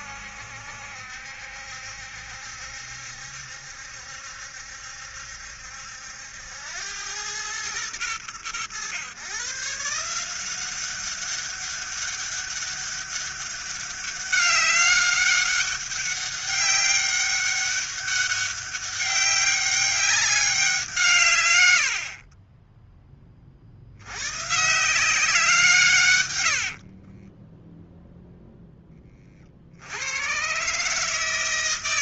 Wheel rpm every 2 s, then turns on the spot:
70, 70, 70, 90, 120, 190, 200, 200, 200, 200, 180, 10, 170, 50, 10, 140.
26-28